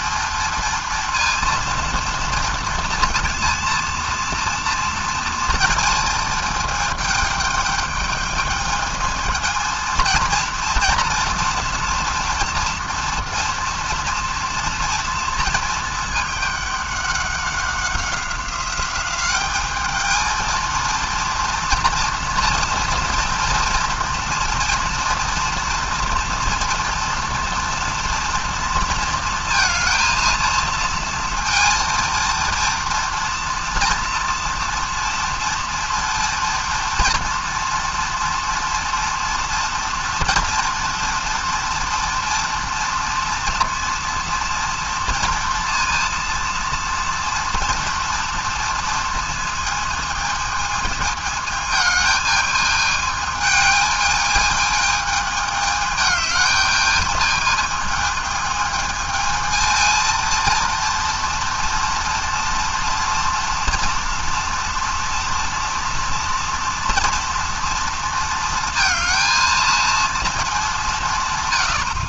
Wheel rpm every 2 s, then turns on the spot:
230, 230, 230, 220, 220, 230, 230, 230, 200, 190, 230, 230, 230, 230, 230, 230, 230, 230, 230, 230, 230, 230, 230, 230, 230, 220, 220, 220, 210, 220, 230, 230, 230, 240, 220, 190.
none